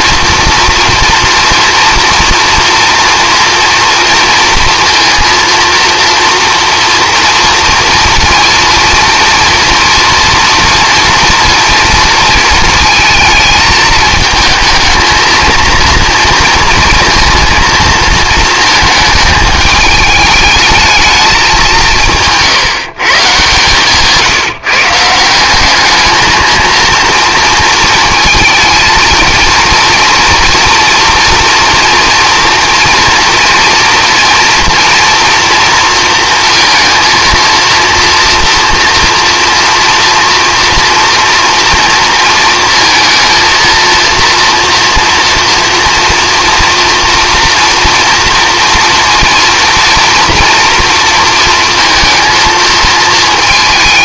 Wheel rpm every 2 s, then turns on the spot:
230, 230, 230, 230, 230, 230, 220, 220, 230, 220, 220, 160, 160, 220, 230, 230, 230, 240, 230, 230, 230, 230, 230, 230, 230, 230, 220.
none